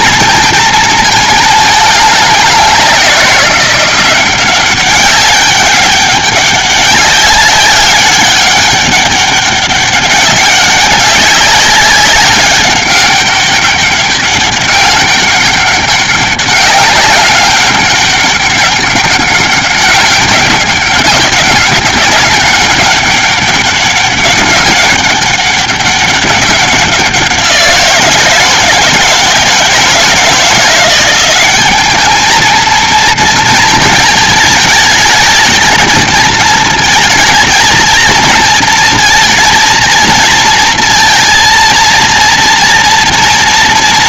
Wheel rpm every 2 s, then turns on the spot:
230, 200, 190, 200, 200, 200, 190, 200, 200, 200, 190, 200, 200, 190, 170, 170, 220, 220, 230, 230, 230, 230.
none